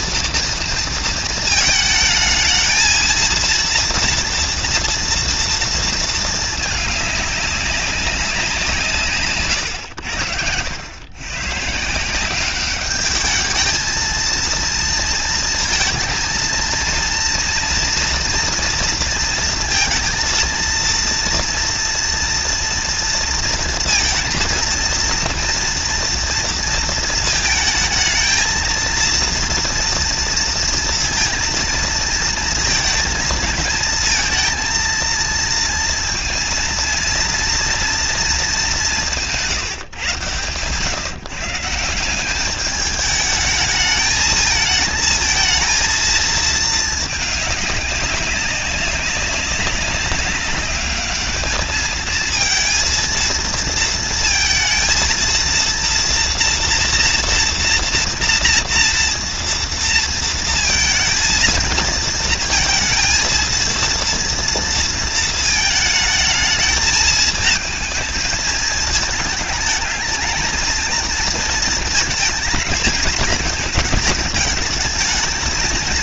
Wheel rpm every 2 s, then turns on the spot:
230, 220, 230, 220, 170, 90, 200, 230, 230, 230, 230, 230, 230, 230, 220, 230, 220, 230, 230, 220, 120, 210, 220, 220, 190, 200, 220, 230, 230, 230, 230, 230, 230, 220, 220, 220, 220, 220.
none